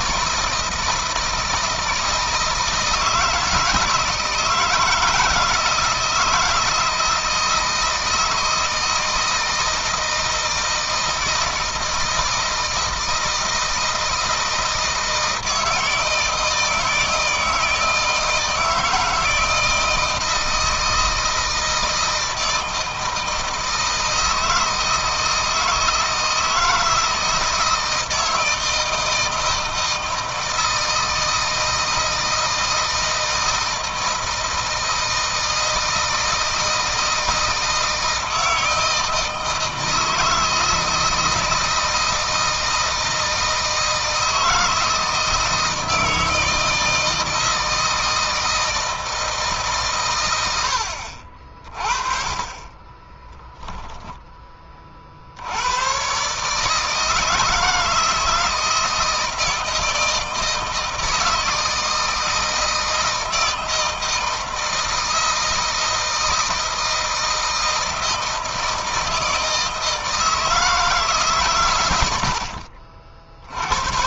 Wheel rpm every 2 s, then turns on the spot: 160, 160, 160, 160, 160, 160, 160, 160, 160, 160, 160, 160, 160, 160, 160, 160, 160, 160, 160, 160, 160, 160, 160, 160, 160, 90, 30, 30, 150, 160, 160, 160, 160, 160, 160, 160, 60.
52-54